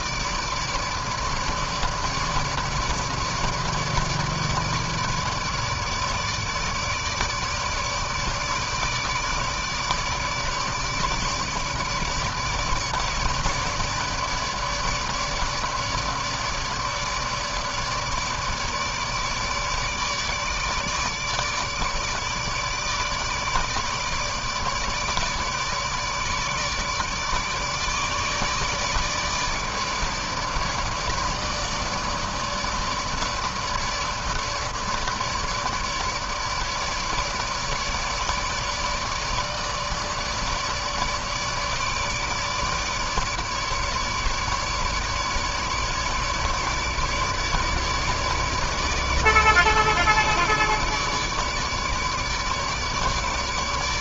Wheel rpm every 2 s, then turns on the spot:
150, 150, 150, 150, 150, 150, 150, 150, 150, 150, 150, 160, 150, 150, 150, 150, 150, 160, 150, 150, 150, 150, 150, 150, 150, 150, 150.
none